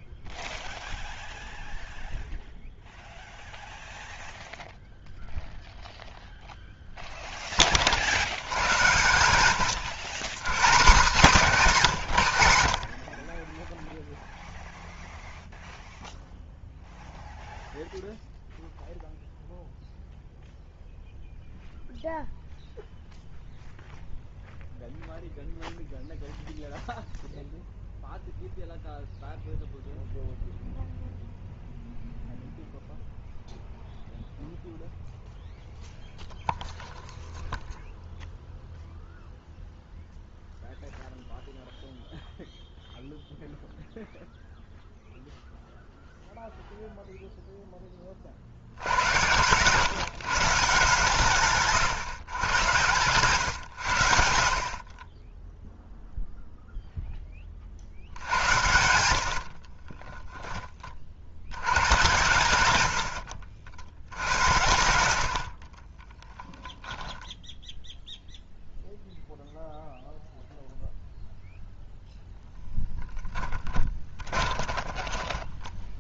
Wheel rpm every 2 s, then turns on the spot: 0, 0, 0, 0, 90, 170, 80, 0, 0, 0, 0, 0, 0, 0, 0, 0, 0, 0, 0, 0, 0, 0, 0, 0, 70, 150, 110, 60, 0, 90, 20, 110, 90, 10, 0, 0, 10, 20.
66-68 74-76